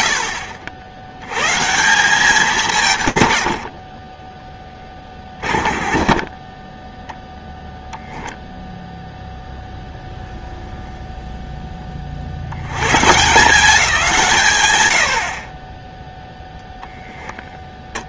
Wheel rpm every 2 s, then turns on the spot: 70, 160, 20, 10, 0, 0, 60, 140, 10.
16-18